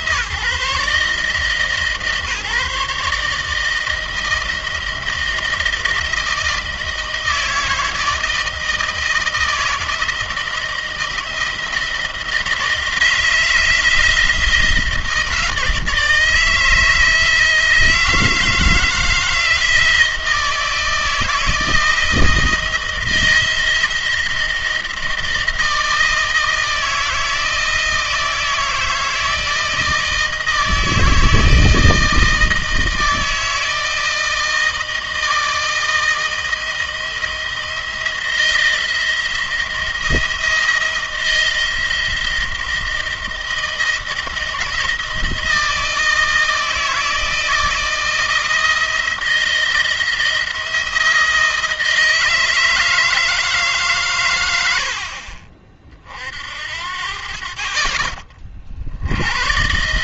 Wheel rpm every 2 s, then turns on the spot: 150, 150, 160, 160, 160, 160, 170, 170, 160, 160, 160, 160, 160, 160, 160, 160, 160, 160, 160, 170, 170, 160, 170, 160, 170, 170, 160, 70, 60, 50.
none